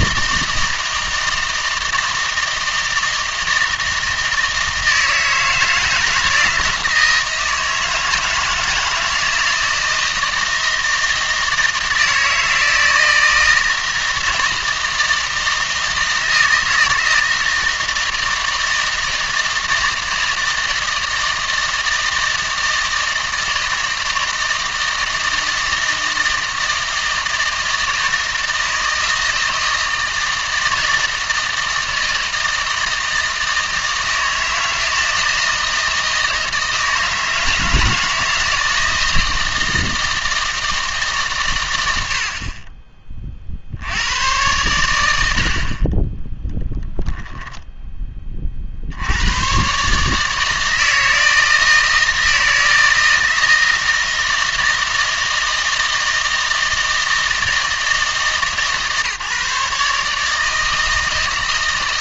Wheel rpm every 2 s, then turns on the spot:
160, 160, 160, 160, 160, 160, 160, 160, 160, 160, 160, 160, 160, 160, 160, 160, 160, 160, 160, 160, 160, 40, 110, 0, 40, 160, 160, 160, 160, 150, 160.
none